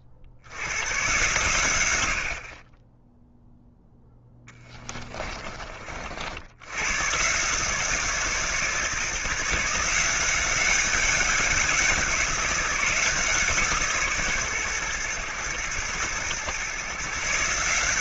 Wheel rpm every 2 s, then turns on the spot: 100, 30, 20, 100, 150, 190, 180, 120, 130.
4-6